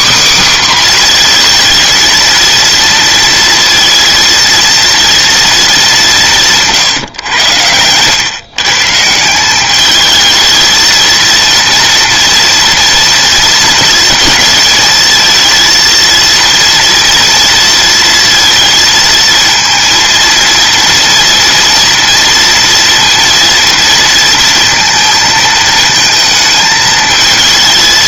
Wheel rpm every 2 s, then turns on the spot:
250, 230, 230, 130, 150, 220, 230, 230, 230, 230, 240, 230, 230, 220.
none